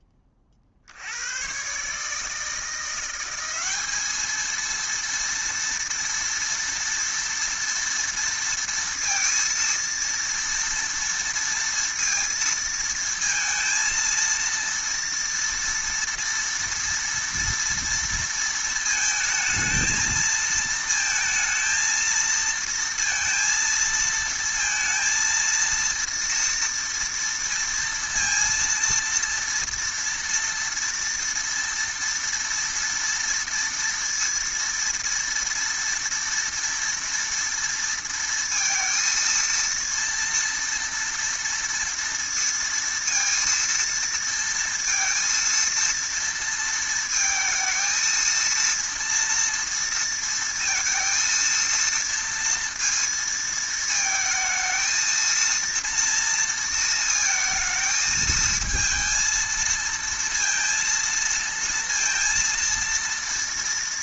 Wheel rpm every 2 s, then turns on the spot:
20, 150, 220, 230, 230, 230, 230, 230, 230, 230, 220, 230, 230, 230, 230, 230, 230, 230, 230, 230, 240, 230, 230, 230, 230, 230, 230, 220, 230, 220, 230, 230.
none